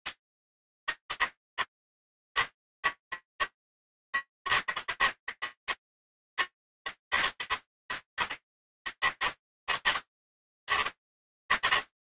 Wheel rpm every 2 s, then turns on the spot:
160, 140, 160, 160, 160, 150.
none